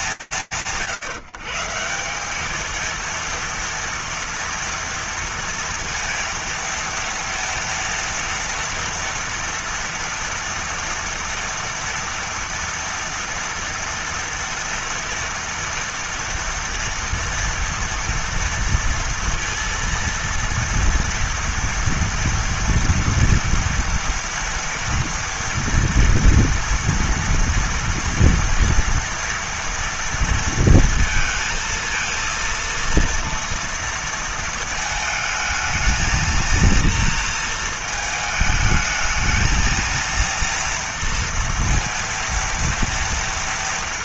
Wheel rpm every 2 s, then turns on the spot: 210, 180, 230, 230, 230, 230, 230, 230, 230, 230, 230, 240, 230, 230, 230, 230, 230, 220, 230, 220, 230, 230.
none